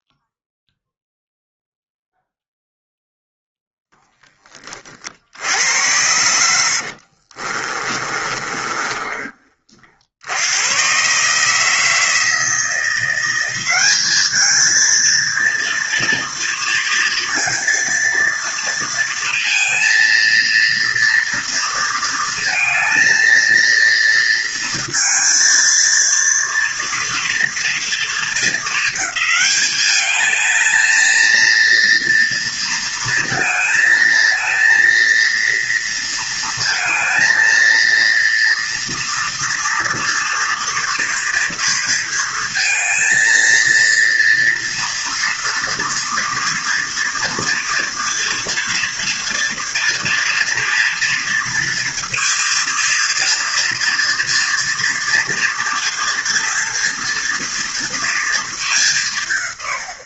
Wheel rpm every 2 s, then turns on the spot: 0, 0, 20, 70, 30, 100, 170, 220, 230, 230, 230, 220, 230, 230, 220, 220, 230, 230, 230, 230, 230, 230, 230, 230, 230, 230, 230, 230, 230, 200.
6-10